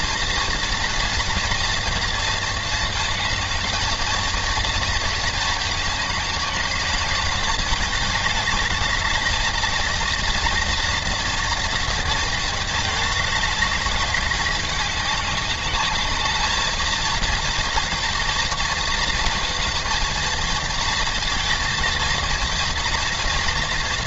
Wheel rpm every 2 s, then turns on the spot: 230, 220, 220, 210, 210, 240, 220, 200, 220, 220, 220, 230.
none